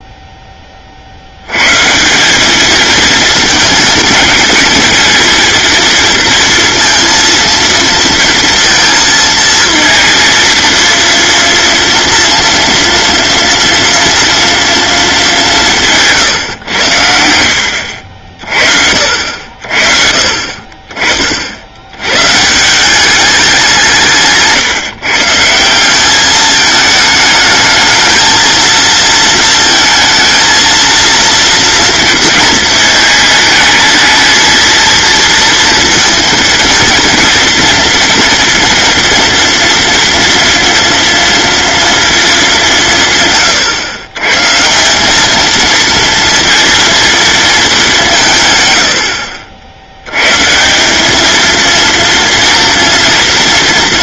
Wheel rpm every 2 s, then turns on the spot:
60, 220, 230, 230, 230, 230, 230, 230, 100, 50, 40, 180, 150, 220, 230, 230, 220, 230, 230, 230, 230, 180, 180, 230, 90, 180, 230.
none